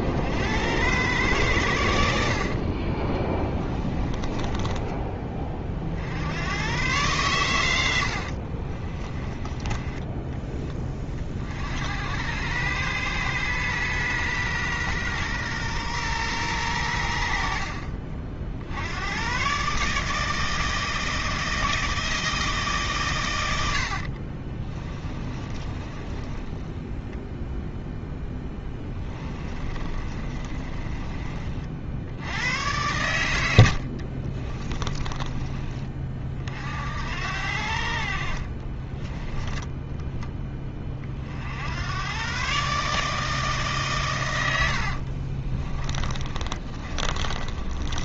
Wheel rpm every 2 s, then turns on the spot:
90, 30, 20, 110, 40, 30, 110, 120, 100, 80, 160, 150, 30, 10, 20, 30, 90, 20, 60, 30, 20, 140, 80, 30.
2-6 8-10 24-32 34-36 38-40 44-48